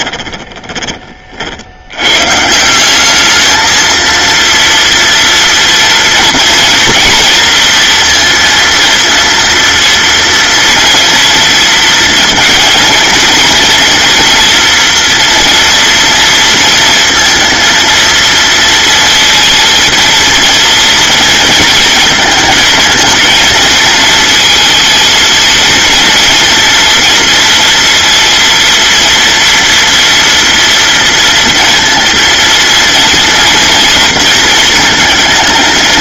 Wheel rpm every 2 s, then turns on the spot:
30, 170, 230, 230, 230, 230, 230, 230, 230, 230, 230, 220, 230, 230, 230, 230, 230, 220.
none